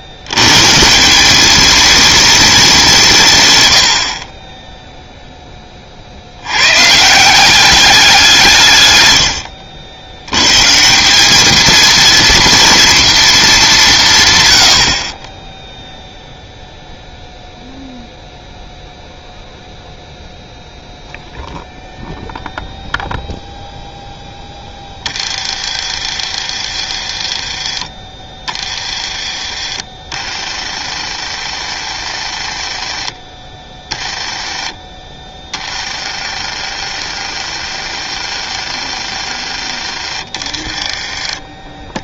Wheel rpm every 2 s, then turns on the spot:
150, 180, 0, 130, 120, 160, 230, 70, 0, 0, 0, 0, 20, 50, 40, 50, 40, 20, 50, 50, 40.
24-42